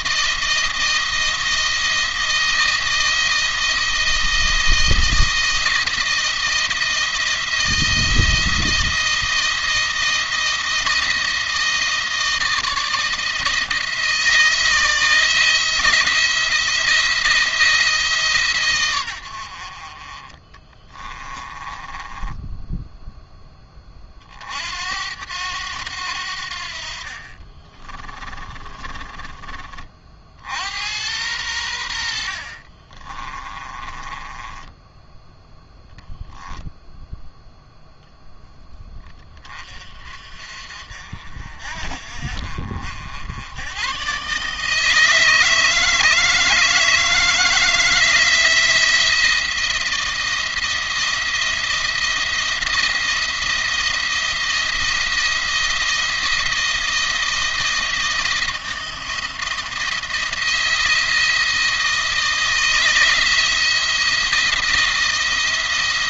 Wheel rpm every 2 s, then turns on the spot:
170, 170, 160, 160, 160, 160, 160, 160, 170, 130, 20, 10, 60, 70, 30, 80, 50, 20, 0, 10, 50, 60, 140, 160, 170, 160, 170, 170, 160, 170, 170, 160, 170.
20-24 28-30 32-36